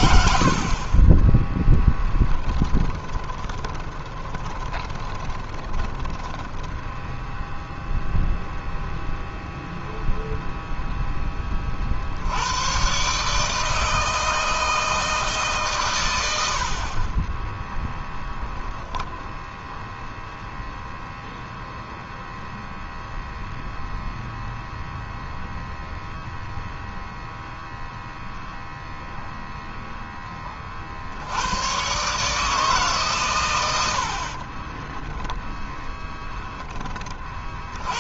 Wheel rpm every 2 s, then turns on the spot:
20, 20, 20, 0, 0, 10, 140, 150, 20, 0, 0, 0, 0, 0, 0, 80, 130, 10, 40.
2-6